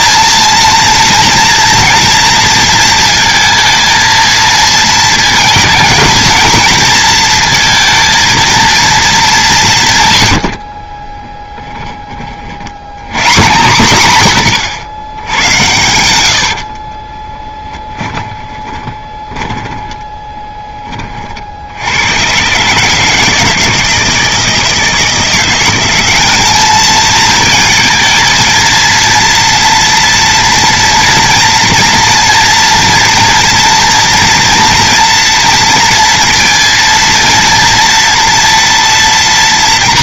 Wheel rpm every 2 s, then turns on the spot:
230, 230, 220, 230, 230, 70, 80, 110, 40, 20, 20, 140, 160, 210, 220, 230, 240, 230, 230, 230.
10-12 16-20